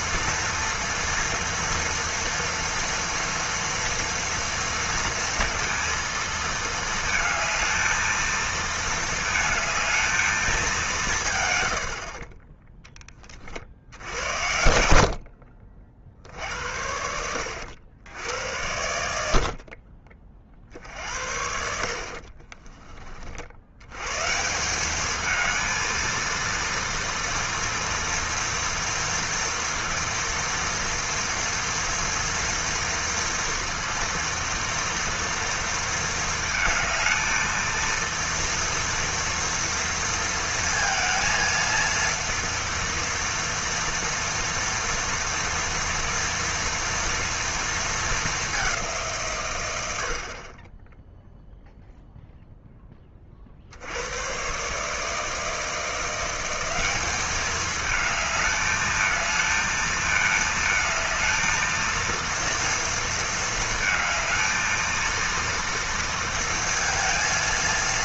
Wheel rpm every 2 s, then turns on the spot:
230, 230, 230, 220, 220, 200, 20, 90, 60, 90, 40, 40, 170, 230, 230, 230, 230, 230, 220, 240, 230, 230, 230, 230, 200, 30, 0, 130, 190, 220, 220, 230, 220, 230.
22-24